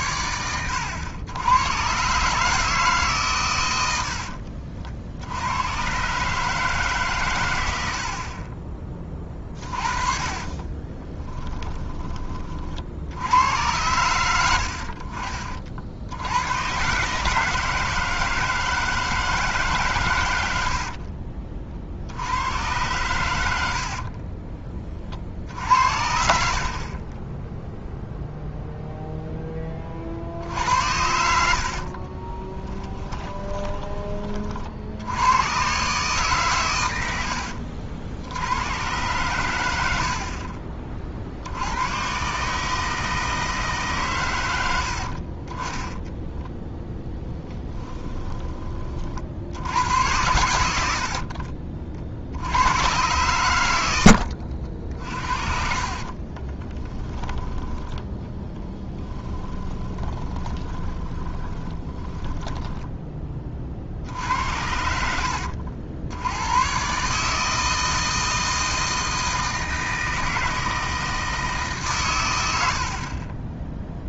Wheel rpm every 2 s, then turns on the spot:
110, 150, 60, 150, 20, 30, 50, 80, 120, 160, 80, 100, 20, 60, 0, 80, 10, 60, 120, 110, 40, 150, 90, 0, 30, 90, 90, 60, 20, 10, 20, 10, 70, 120, 160, 160, 70.
10-12 20-22 32-34 56-64